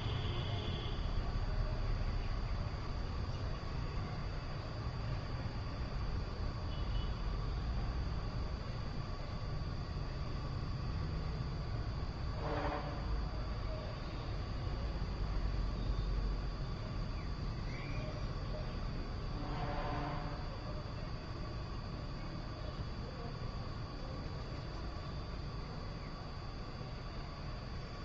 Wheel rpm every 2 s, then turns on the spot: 0, 0, 0, 0, 0, 0, 0, 0, 0, 0, 0, 0, 0, 0.
none